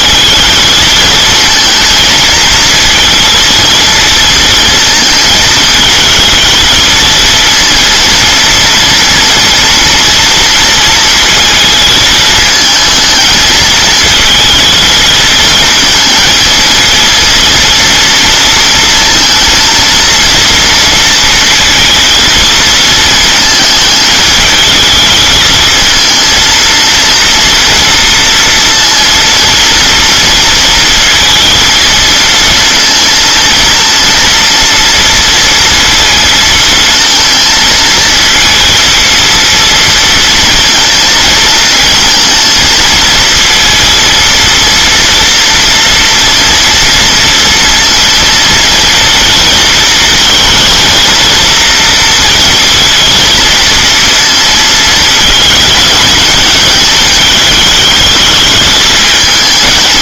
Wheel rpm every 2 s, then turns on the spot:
220, 230, 230, 220, 230, 230, 220, 220, 220, 230, 230, 230, 220, 230, 230, 230, 230, 230, 230, 230, 230, 230, 230, 230, 230, 230, 230, 230, 220, 220.
none